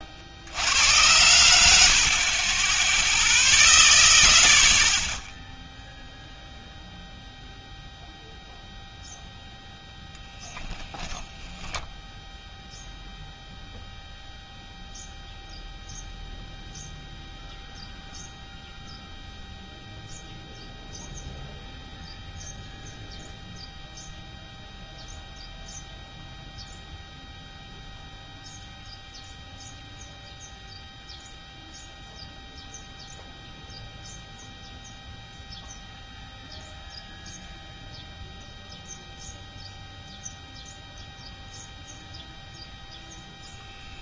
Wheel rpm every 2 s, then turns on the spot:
70, 30, 0, 0, 0, 10, 0, 0, 0, 0, 0, 0, 0, 0, 0, 0, 0, 0, 0, 0, 0, 0.
2-4 10-12